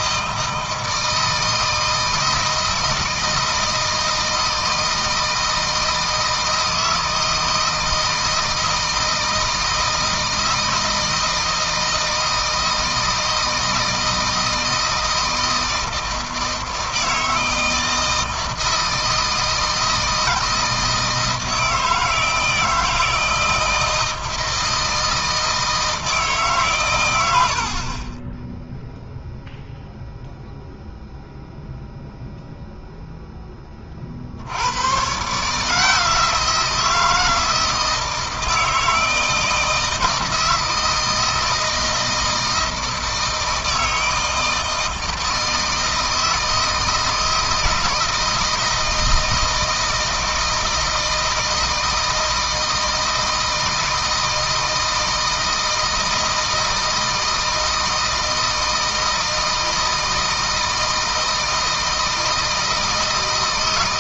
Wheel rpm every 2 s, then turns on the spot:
160, 160, 160, 160, 160, 160, 160, 160, 160, 160, 160, 160, 160, 110, 0, 0, 0, 100, 160, 160, 160, 160, 160, 160, 160, 160, 160, 160, 160, 160, 160, 160.
none